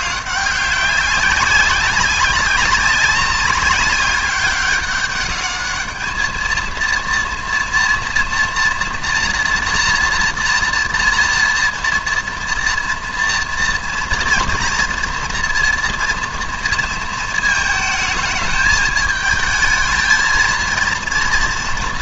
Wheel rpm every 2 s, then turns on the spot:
200, 190, 200, 230, 230, 240, 230, 230, 230, 220, 230.
none